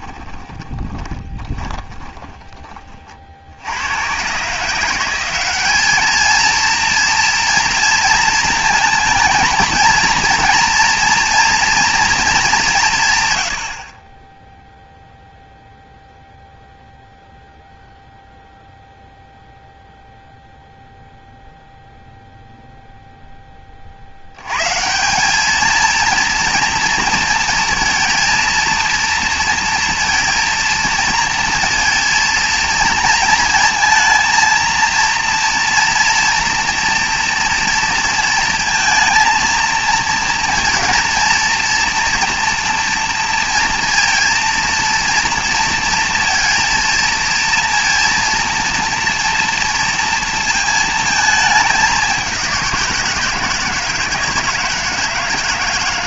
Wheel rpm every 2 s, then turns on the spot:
20, 40, 180, 230, 220, 230, 150, 0, 0, 0, 0, 0, 190, 230, 230, 230, 230, 230, 230, 230, 230, 230, 230, 230, 230, 220, 170, 160.
0-2